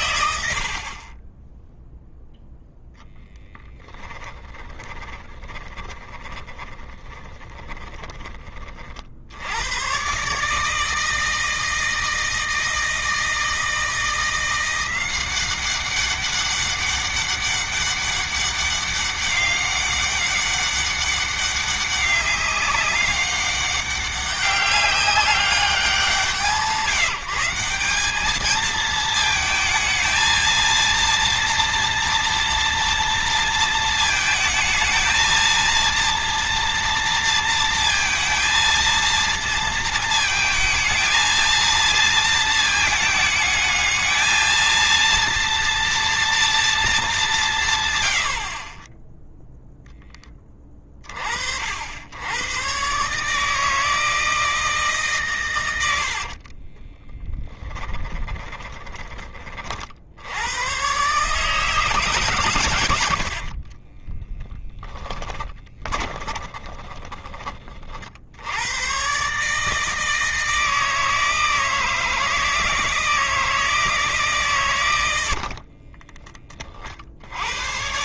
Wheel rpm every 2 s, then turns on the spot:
30, 10, 30, 20, 60, 160, 160, 180, 200, 200, 200, 200, 190, 180, 220, 230, 230, 230, 230, 230, 220, 220, 230, 220, 30, 30, 130, 150, 20, 20, 120, 90, 10, 20, 120, 160, 160, 100, 50.
4-8 56-58 64-68